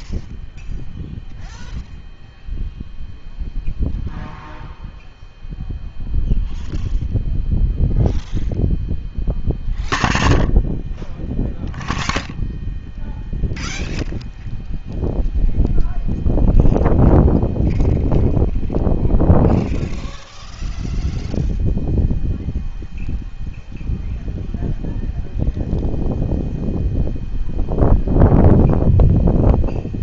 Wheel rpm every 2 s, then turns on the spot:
0, 0, 0, 0, 0, 0, 0, 0, 0, 0, 0, 0, 0, 0, 0.
none